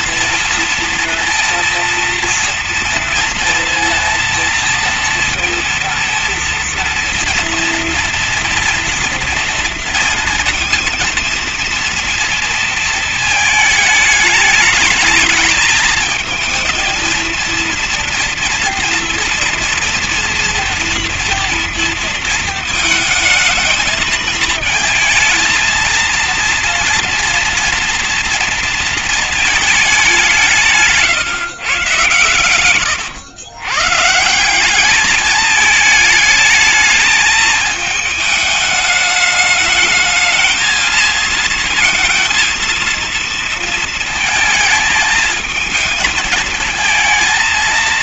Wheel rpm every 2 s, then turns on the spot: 230, 230, 230, 230, 230, 230, 230, 220, 220, 230, 230, 220, 220, 230, 230, 160, 130, 190, 220, 210, 220, 230, 220, 220.
32-34